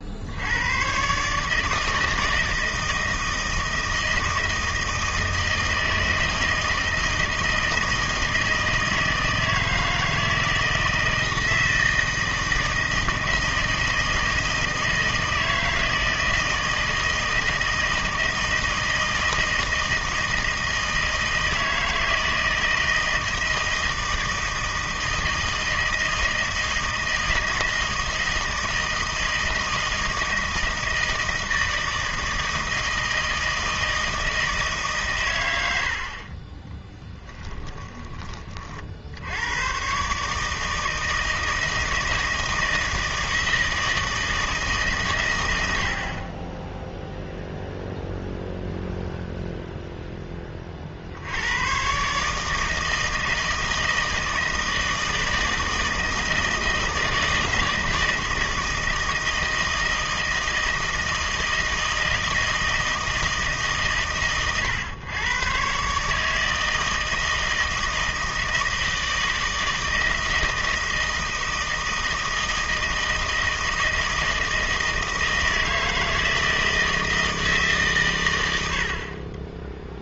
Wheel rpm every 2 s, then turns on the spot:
100, 160, 160, 160, 160, 160, 160, 160, 160, 160, 160, 160, 160, 160, 160, 160, 160, 150, 20, 40, 160, 160, 150, 10, 0, 30, 160, 160, 160, 160, 160, 160, 120, 160, 160, 160, 160, 160, 160, 80.
36-38